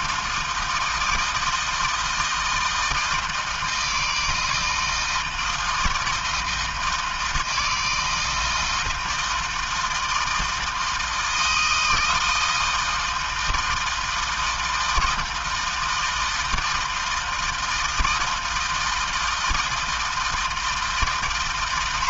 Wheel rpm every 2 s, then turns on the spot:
160, 160, 160, 160, 160, 160, 160, 160, 160, 160, 140.
none